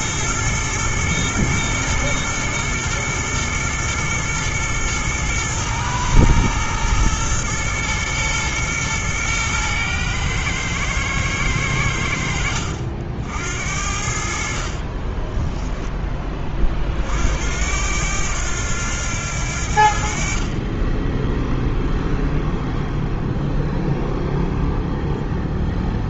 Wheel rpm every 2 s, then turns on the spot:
110, 110, 110, 110, 120, 110, 70, 50, 30, 90, 20, 0, 0.
14-16